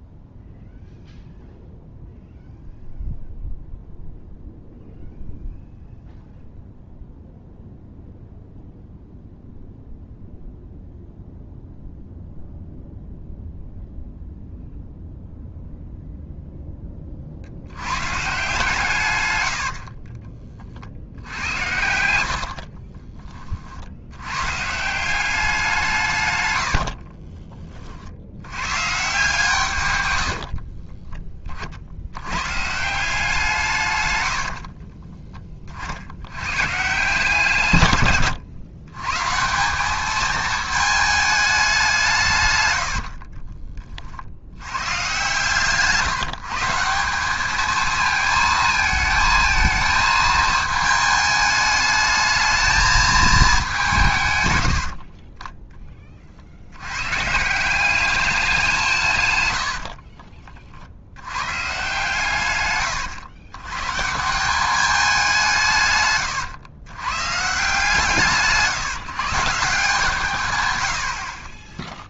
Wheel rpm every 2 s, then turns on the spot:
0, 0, 0, 0, 0, 0, 0, 0, 10, 140, 40, 70, 130, 110, 110, 70, 130, 60, 130, 110, 220, 120, 100, 160, 220, 220, 220, 110, 70, 190, 40, 120, 190, 120, 160, 120.
22-24 26-28 30-32 34-36